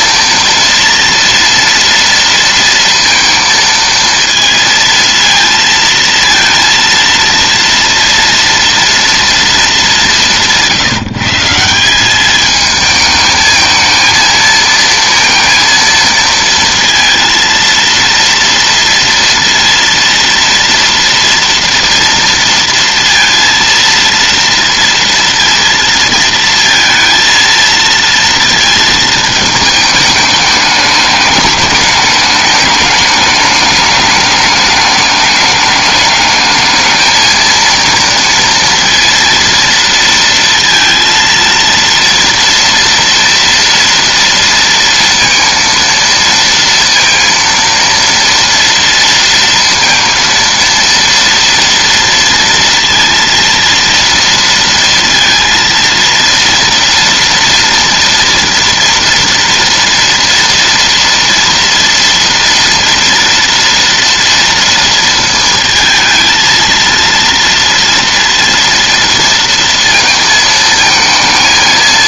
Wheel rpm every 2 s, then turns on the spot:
230, 230, 230, 230, 230, 170, 210, 220, 230, 230, 230, 230, 230, 230, 220, 210, 210, 200, 220, 230, 230, 230, 230, 230, 230, 230, 230, 230, 230, 240, 240, 230, 230, 230, 230, 220.
none